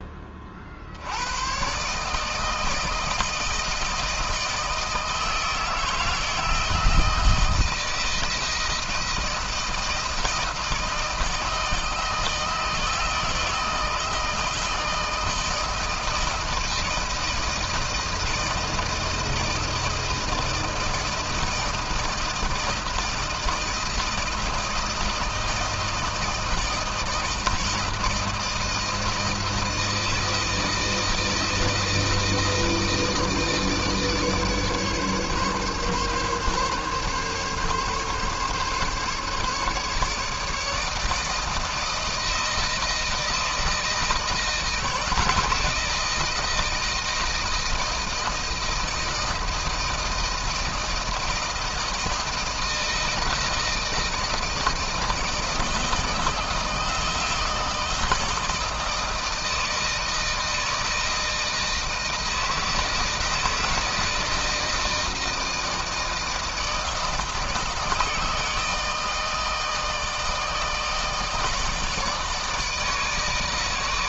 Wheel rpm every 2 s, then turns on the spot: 70, 160, 160, 160, 160, 160, 160, 160, 160, 160, 160, 160, 160, 160, 160, 160, 160, 150, 140, 140, 160, 170, 160, 160, 160, 160, 160, 160, 160, 160, 160, 160, 160, 160, 160, 160, 160.
none